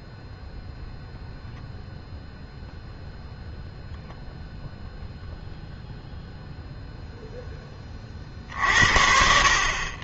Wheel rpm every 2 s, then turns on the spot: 0, 0, 0, 0, 50.
none